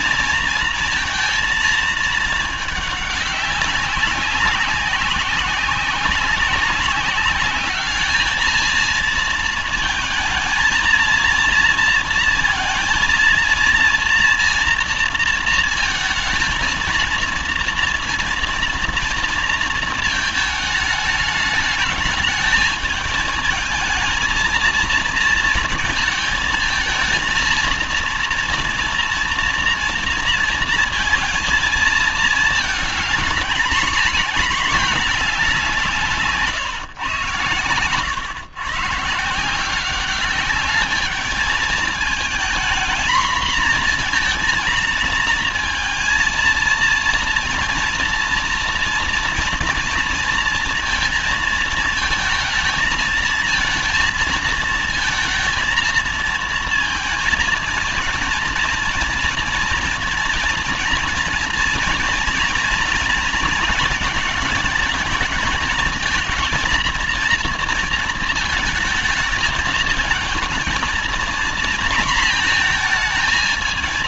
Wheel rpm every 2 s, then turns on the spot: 230, 210, 190, 200, 220, 230, 230, 230, 230, 220, 210, 220, 220, 220, 230, 230, 220, 220, 130, 130, 210, 230, 230, 220, 230, 230, 220, 230, 230, 230, 230, 230, 220, 230, 230, 230, 230.
none